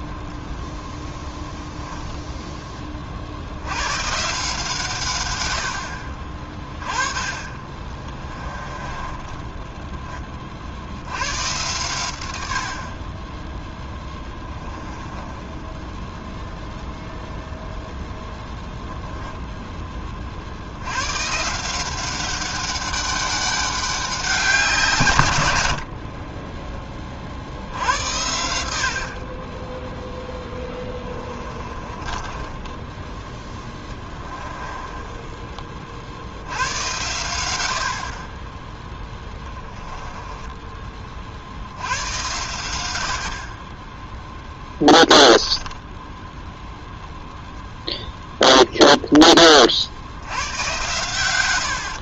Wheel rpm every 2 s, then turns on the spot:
0, 20, 140, 30, 20, 50, 70, 20, 0, 0, 80, 190, 170, 20, 70, 20, 10, 10, 100, 10, 20, 90, 10, 0, 0, 110.
8-10 14-16 30-36